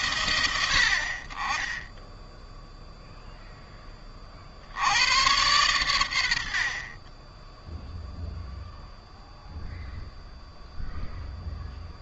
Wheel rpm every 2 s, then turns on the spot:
60, 0, 90, 30, 0, 0.
none